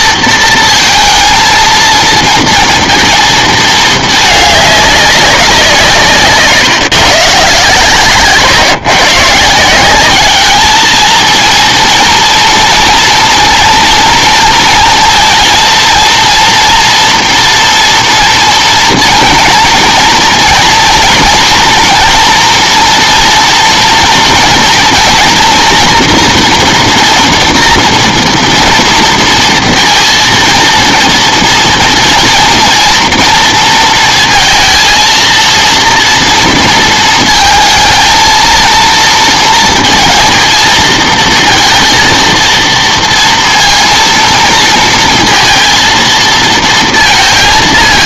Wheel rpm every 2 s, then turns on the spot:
230, 230, 200, 140, 130, 220, 230, 230, 230, 230, 240, 230, 230, 240, 240, 230, 230, 230, 230, 230, 220, 230, 230, 230.
none